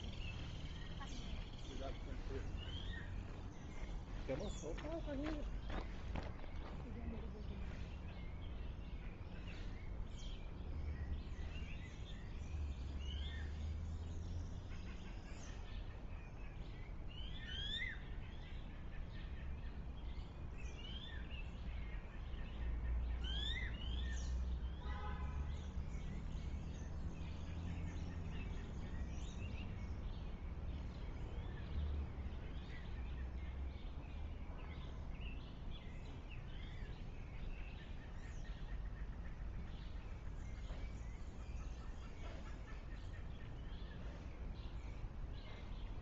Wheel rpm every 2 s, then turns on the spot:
0, 0, 0, 0, 0, 0, 0, 0, 0, 0, 0, 0, 0, 0, 0, 0, 0, 0, 0, 0, 0, 0, 0.
none